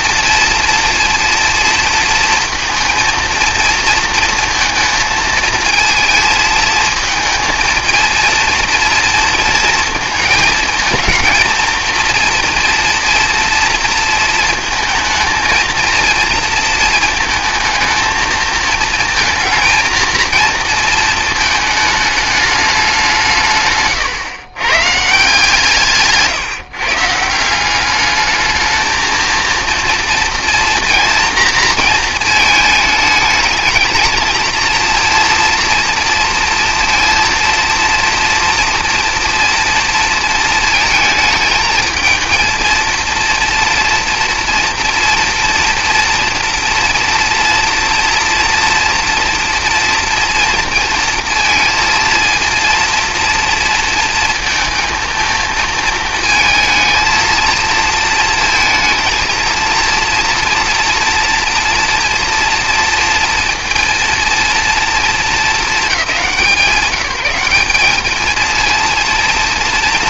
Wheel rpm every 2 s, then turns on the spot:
230, 230, 230, 220, 230, 220, 230, 230, 230, 220, 230, 200, 130, 140, 210, 230, 220, 220, 230, 230, 220, 230, 230, 230, 230, 230, 230, 230, 220, 230, 240, 230, 230, 180, 220.
none